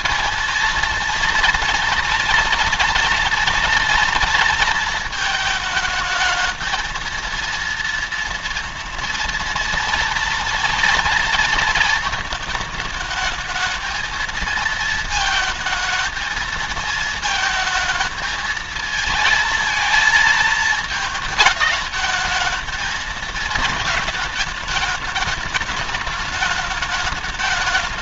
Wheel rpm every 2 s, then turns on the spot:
230, 230, 230, 220, 230, 230, 220, 230, 220, 220, 220, 210, 210, 220.
none